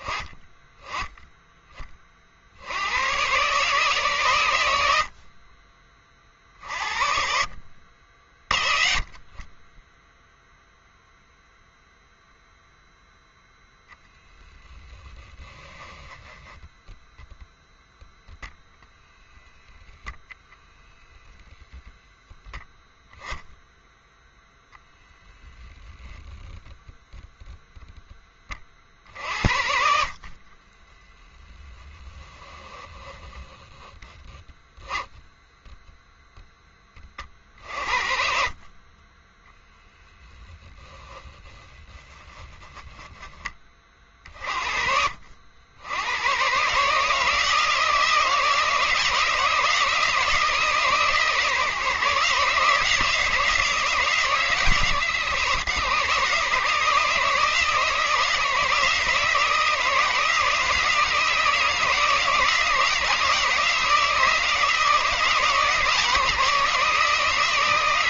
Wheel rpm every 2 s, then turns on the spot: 20, 70, 100, 50, 40, 0, 0, 10, 0, 0, 0, 0, 0, 0, 40, 30, 10, 10, 10, 40, 10, 10, 50, 130, 160, 160, 150, 140, 150, 160, 160, 160, 160, 160.
30-34 40-42